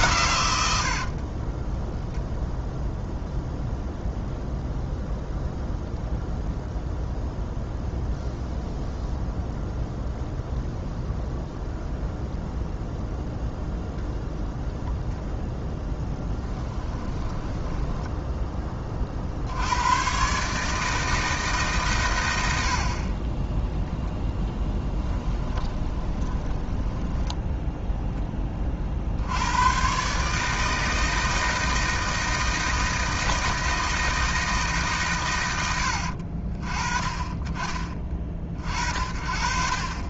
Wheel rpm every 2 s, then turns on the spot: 80, 10, 0, 0, 0, 0, 0, 0, 10, 20, 150, 70, 10, 10, 40, 160, 160, 150, 30, 40.
0-2 16-18 24-28